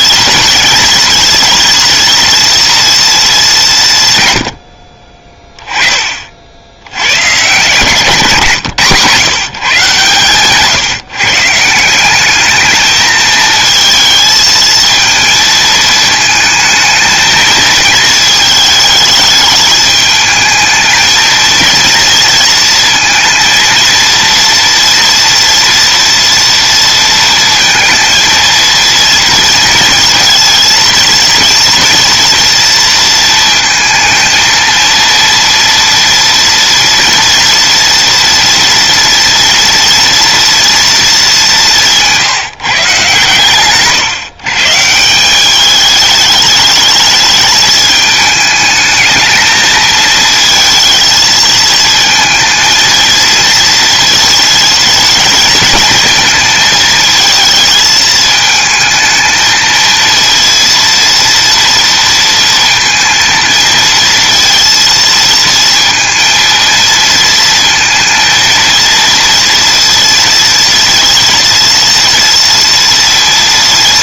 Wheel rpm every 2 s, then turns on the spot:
230, 220, 40, 100, 130, 150, 220, 220, 220, 220, 220, 230, 230, 230, 230, 230, 230, 230, 240, 230, 220, 150, 180, 220, 220, 220, 220, 220, 220, 220, 230, 230, 230, 230, 230, 230, 230.
4-6